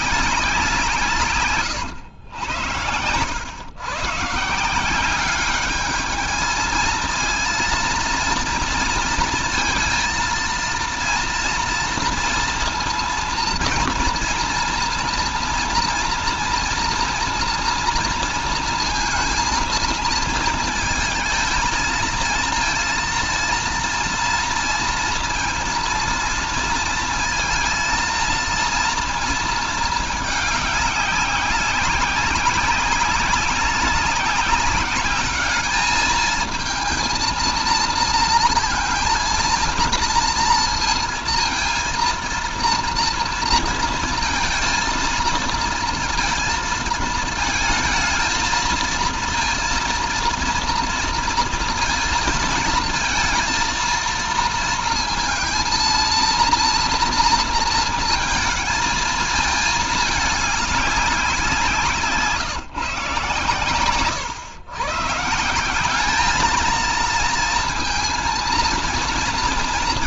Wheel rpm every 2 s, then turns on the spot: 170, 90, 160, 220, 230, 230, 230, 230, 240, 230, 230, 230, 230, 230, 230, 210, 190, 190, 220, 230, 230, 230, 230, 230, 230, 240, 220, 230, 230, 230, 210, 160, 140, 220, 230.
none